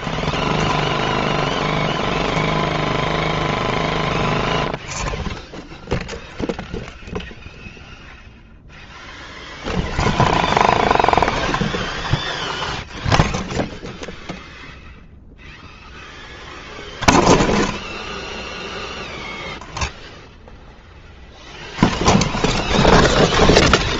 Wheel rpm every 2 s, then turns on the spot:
10, 0, 0, 0, 0, 10, 0, 0, 0, 0, 0, 10.
none